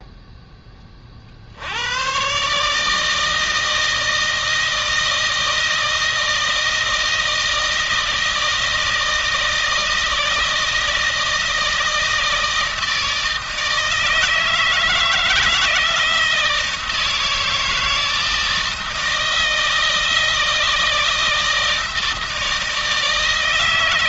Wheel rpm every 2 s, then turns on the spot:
10, 140, 160, 160, 160, 160, 160, 160, 160, 160, 160, 160.
none